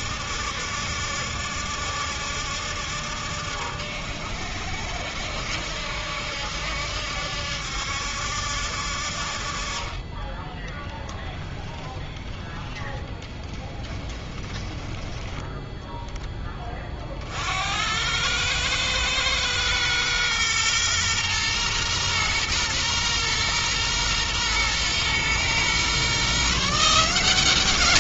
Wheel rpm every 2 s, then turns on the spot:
70, 70, 70, 70, 70, 10, 10, 10, 40, 110, 120, 120, 120, 160.
10-14